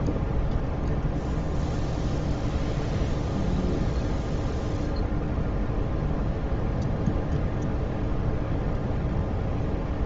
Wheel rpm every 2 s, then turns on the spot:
0, 0, 0, 0, 0.
none